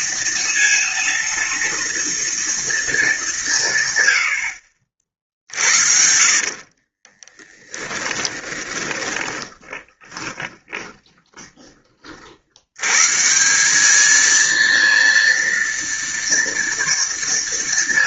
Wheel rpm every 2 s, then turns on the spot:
230, 230, 100, 50, 10, 10, 50, 220, 230.
6-12